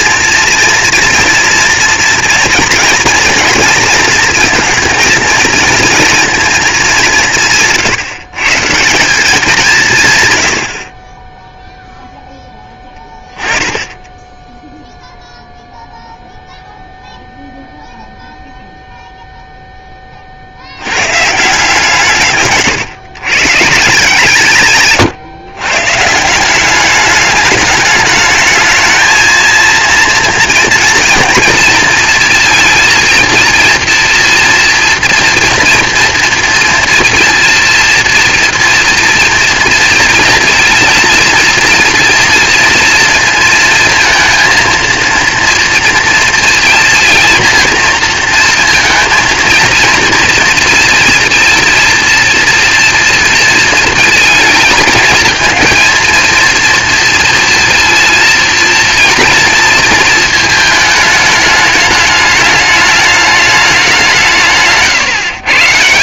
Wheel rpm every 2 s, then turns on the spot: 240, 230, 230, 220, 150, 80, 10, 10, 0, 0, 70, 140, 140, 180, 220, 230, 230, 230, 230, 230, 230, 230, 230, 230, 230, 230, 230, 220, 230, 230, 220, 210, 150.
22-24